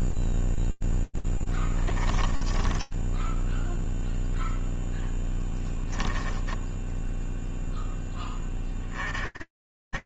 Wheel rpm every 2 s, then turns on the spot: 0, 10, 0, 20, 20.
2-4 6-8